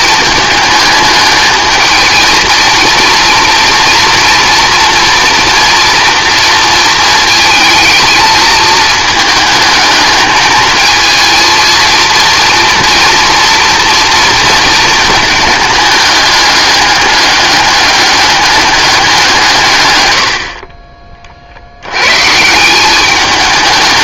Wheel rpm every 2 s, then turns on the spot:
220, 230, 230, 230, 220, 220, 230, 230, 200, 210, 60, 170.
none